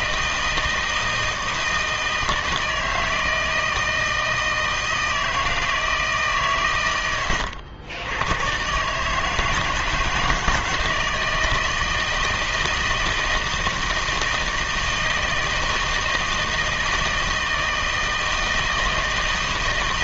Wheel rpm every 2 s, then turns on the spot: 160, 160, 160, 130, 120, 160, 160, 160, 160, 160.
none